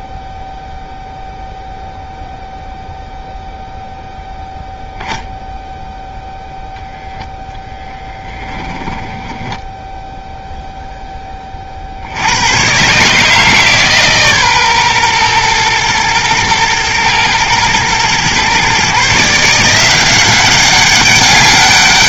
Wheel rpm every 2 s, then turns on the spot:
0, 0, 0, 0, 10, 10, 130, 130, 110, 140, 200.
8-10